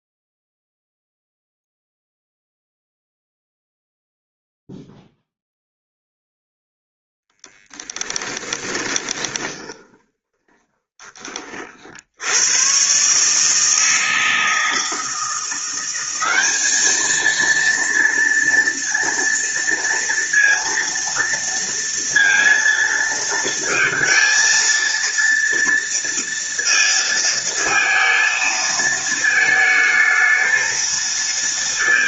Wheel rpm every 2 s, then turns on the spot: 0, 0, 0, 0, 20, 20, 130, 160, 210, 230, 230, 230, 230, 230, 220, 220.
8-12